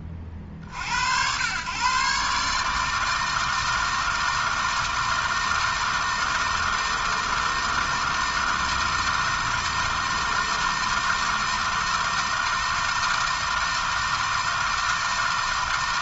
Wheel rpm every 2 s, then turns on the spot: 70, 150, 160, 160, 160, 160, 160, 160.
none